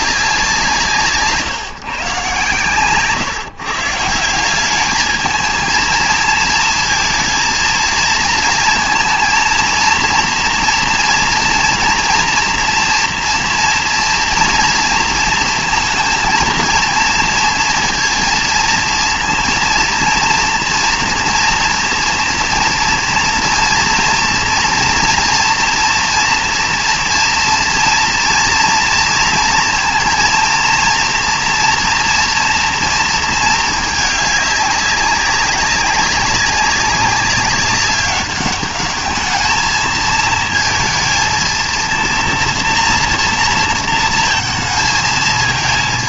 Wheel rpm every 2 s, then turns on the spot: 170, 120, 210, 220, 230, 240, 230, 230, 230, 230, 230, 230, 230, 230, 230, 230, 230, 200, 200, 200, 220, 230, 220.
none